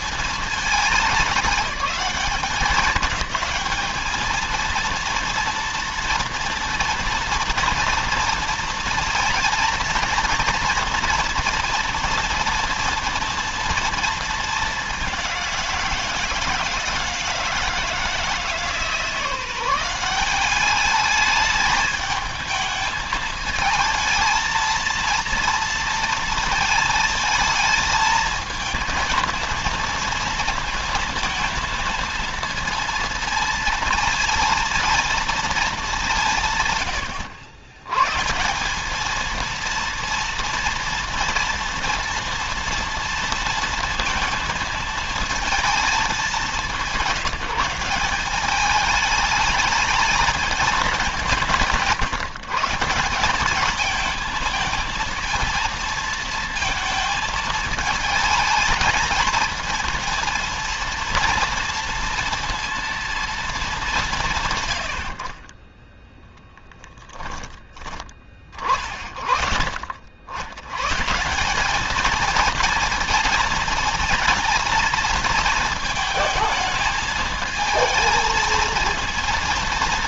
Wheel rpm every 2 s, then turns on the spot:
210, 200, 230, 240, 230, 230, 230, 210, 160, 160, 200, 220, 230, 230, 220, 230, 230, 230, 150, 170, 230, 230, 230, 200, 200, 210, 150, 220, 230, 220, 230, 230, 140, 10, 40, 100, 220, 230, 220, 220.
66-68